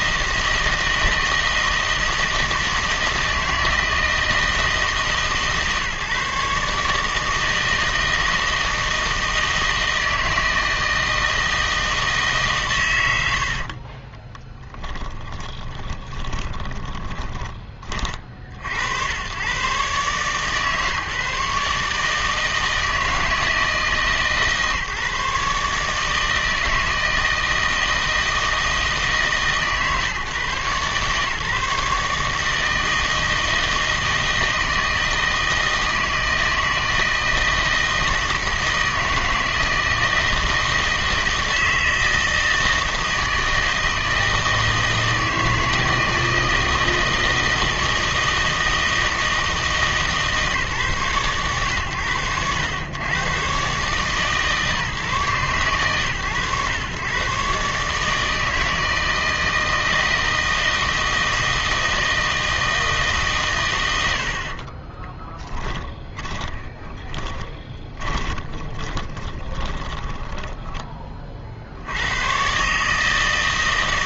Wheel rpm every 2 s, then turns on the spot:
160, 160, 150, 150, 160, 160, 130, 10, 20, 70, 150, 160, 150, 160, 150, 140, 160, 160, 160, 160, 160, 160, 160, 160, 160, 140, 100, 140, 110, 160, 160, 160, 40, 10, 20, 20, 140.
14-18 64-70